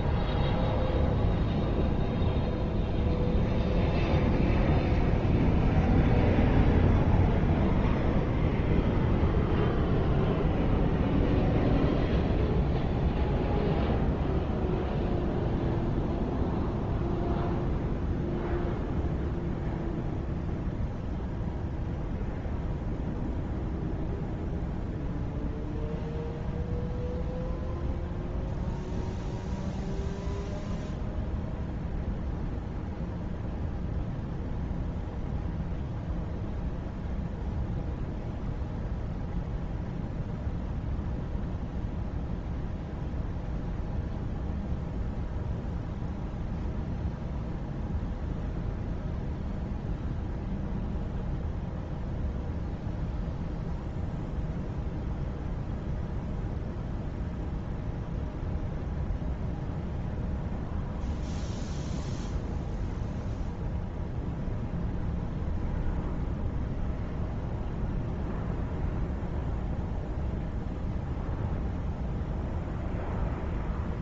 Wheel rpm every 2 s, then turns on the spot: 0, 0, 0, 0, 0, 0, 0, 0, 0, 0, 0, 0, 0, 0, 0, 0, 0, 0, 0, 0, 0, 0, 0, 0, 0, 0, 0, 0, 0, 0, 0, 0, 0, 0, 0, 0, 0.
none